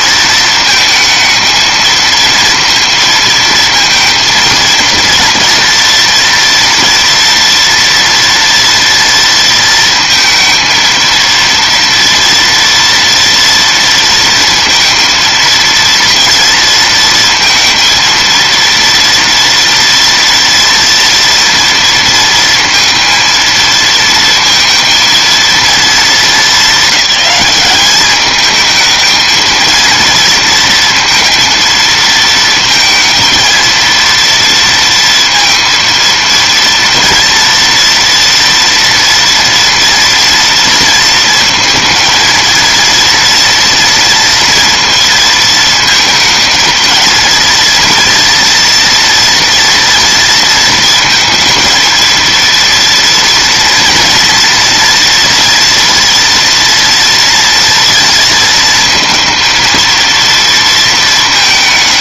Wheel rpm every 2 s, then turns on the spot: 220, 230, 230, 230, 230, 230, 230, 230, 230, 230, 230, 230, 230, 210, 220, 230, 220, 230, 230, 230, 230, 230, 230, 230, 230, 220, 230, 230, 230, 230, 230.
none